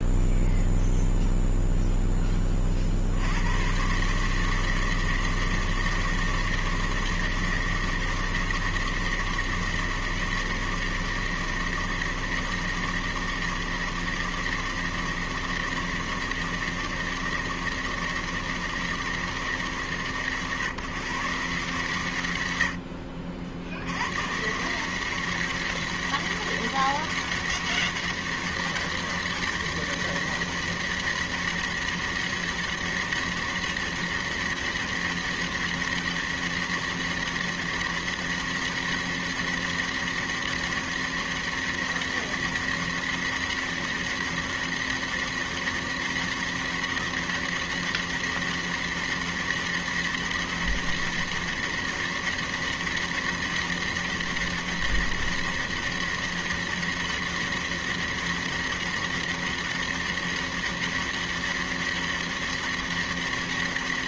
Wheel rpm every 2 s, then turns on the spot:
0, 30, 160, 160, 160, 160, 160, 160, 160, 160, 140, 100, 160, 200, 200, 200, 200, 200, 200, 200, 200, 200, 200, 200, 200, 200, 200, 200, 200, 200, 200, 200.
none